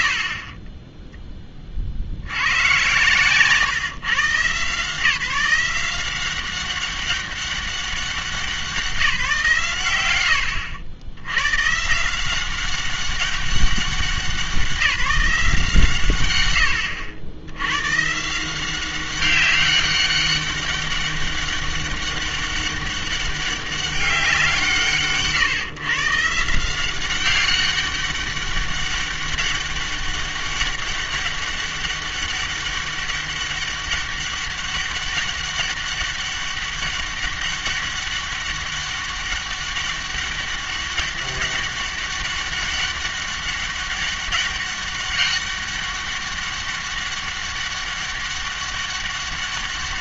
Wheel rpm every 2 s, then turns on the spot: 40, 110, 140, 190, 180, 90, 190, 180, 100, 180, 200, 200, 160, 170, 200, 200, 200, 200, 200, 200, 200, 200, 200, 200, 200.
0-2